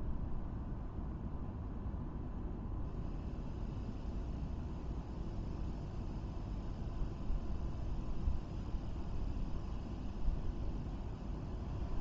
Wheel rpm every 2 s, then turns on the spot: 0, 0, 0, 0, 0, 0.
none